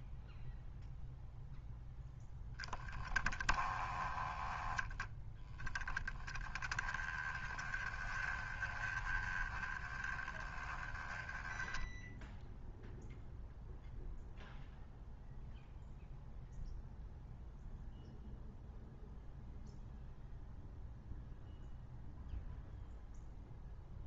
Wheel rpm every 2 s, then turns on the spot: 0, 10, 10, 10, 20, 10, 0, 0, 0, 0, 0, 0.
none